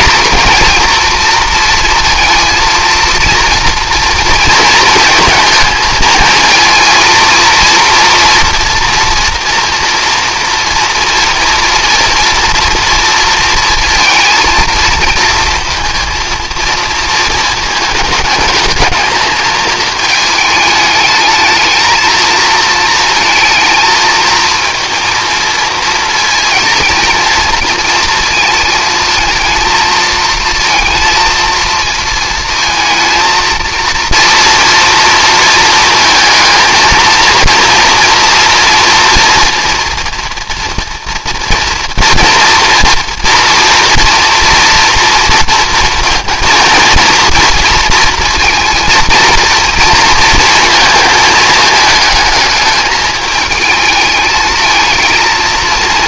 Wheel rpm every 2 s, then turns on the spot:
230, 230, 230, 230, 240, 230, 230, 230, 220, 220, 210, 220, 230, 220, 230, 230, 220, 230, 220, 230, 230, 230, 240, 230, 230, 230, 220, 220.
none